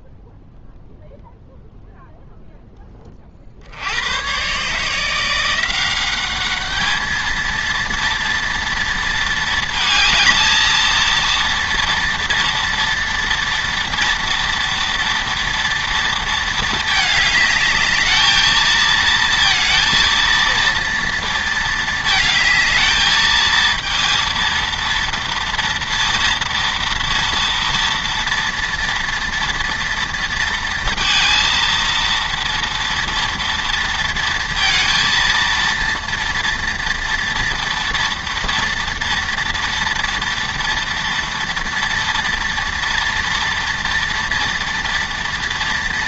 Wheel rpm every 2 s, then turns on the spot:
0, 0, 140, 210, 230, 230, 240, 230, 220, 220, 230, 220, 230, 230, 230, 230, 230, 230, 230, 230, 230, 230, 230.
none